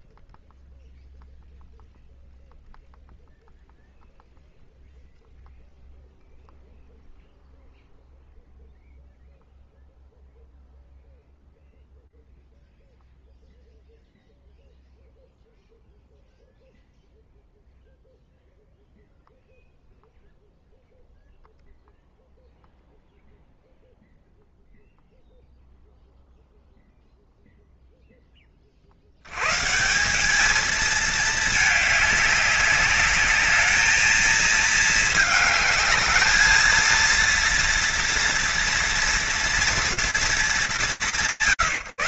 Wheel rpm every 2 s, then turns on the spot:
0, 0, 0, 0, 0, 0, 0, 0, 0, 0, 0, 0, 0, 0, 10, 200, 200, 220, 220, 230, 220.
none